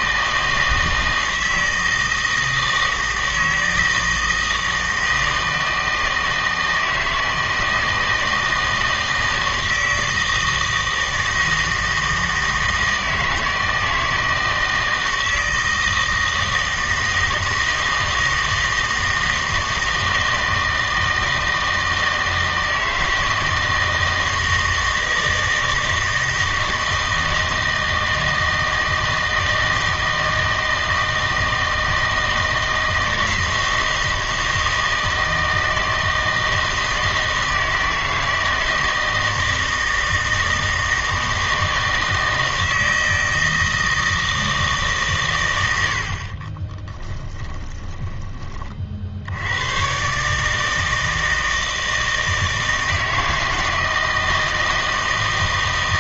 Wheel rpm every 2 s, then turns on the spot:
160, 160, 160, 160, 160, 160, 160, 160, 160, 160, 160, 160, 160, 160, 160, 160, 160, 160, 160, 160, 160, 160, 150, 20, 30, 160, 160, 160.
46-48